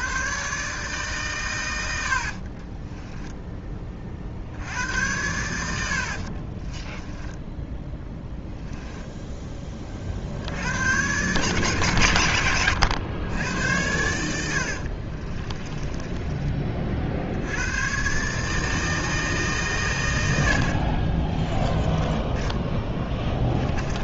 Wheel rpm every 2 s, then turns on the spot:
140, 30, 80, 30, 10, 80, 110, 80, 30, 150, 70, 10.
2-4 6-10 14-16 20-24